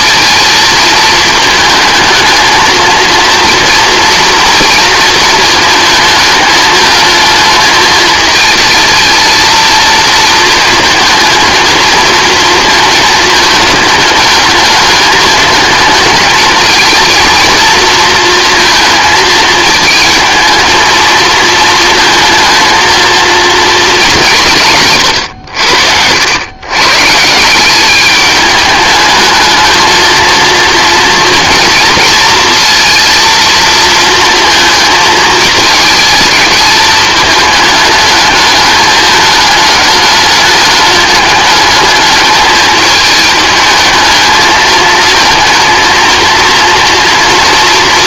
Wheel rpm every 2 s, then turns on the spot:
220, 230, 230, 220, 220, 230, 230, 210, 220, 230, 220, 230, 150, 130, 210, 230, 230, 230, 220, 210, 210, 210, 220, 230.
24-26